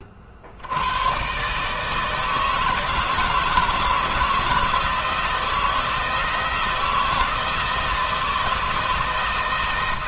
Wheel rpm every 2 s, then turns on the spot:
80, 160, 170, 170, 160.
none